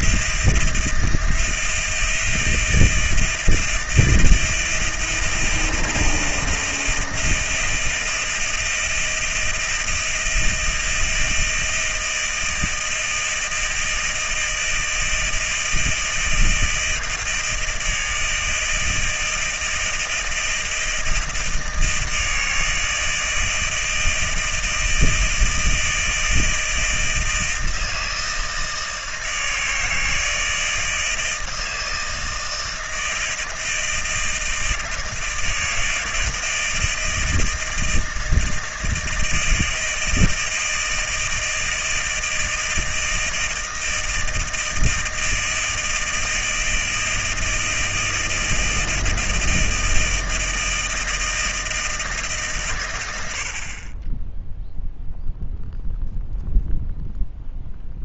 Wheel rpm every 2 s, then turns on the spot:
160, 160, 160, 160, 170, 160, 160, 160, 160, 160, 160, 160, 160, 160, 160, 160, 160, 160, 170, 160, 160, 160, 160, 160, 160, 160, 160, 20, 0.
none